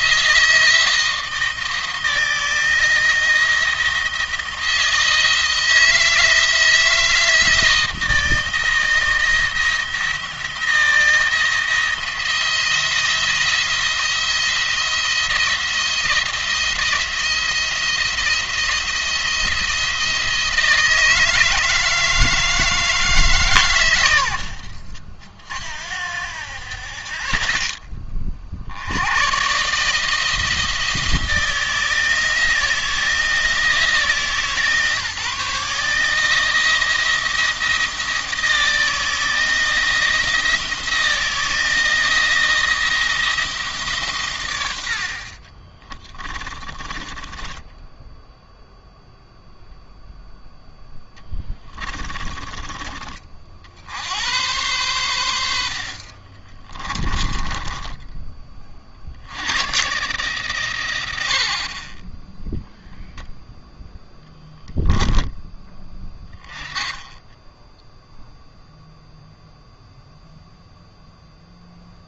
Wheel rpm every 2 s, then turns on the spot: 160, 170, 160, 160, 170, 170, 170, 170, 170, 170, 160, 160, 60, 40, 50, 160, 160, 150, 160, 160, 170, 170, 80, 20, 0, 0, 20, 110, 20, 30, 130, 0, 10, 20, 0, 0.
46-48 56-58